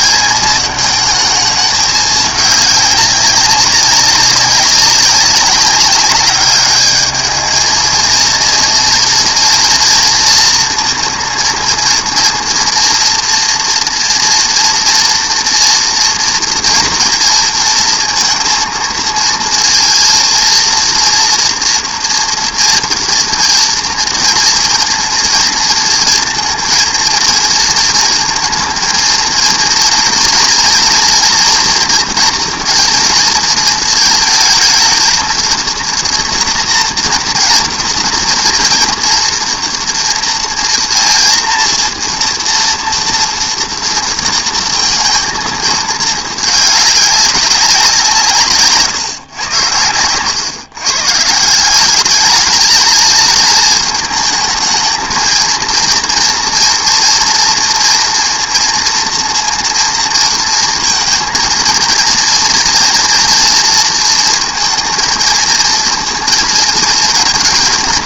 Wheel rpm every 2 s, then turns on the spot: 220, 210, 200, 210, 230, 230, 230, 230, 240, 230, 230, 230, 230, 230, 230, 230, 230, 220, 230, 240, 230, 230, 230, 210, 150, 130, 210, 220, 230, 230, 230, 240, 230, 230.
none